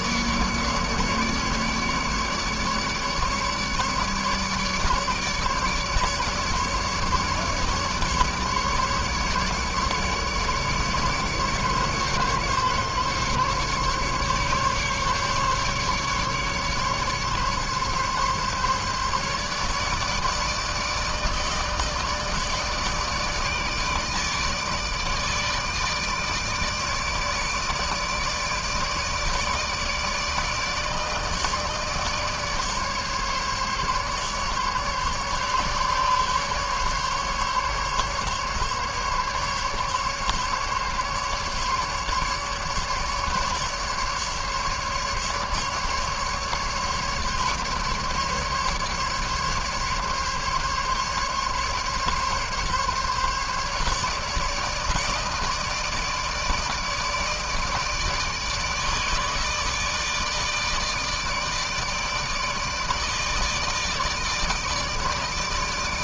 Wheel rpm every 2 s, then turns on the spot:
150, 150, 150, 150, 150, 150, 140, 140, 140, 140, 150, 160, 150, 150, 160, 160, 150, 140, 140, 140, 140, 150, 150, 140, 150, 140, 140, 150, 160, 150, 160, 160, 160.
none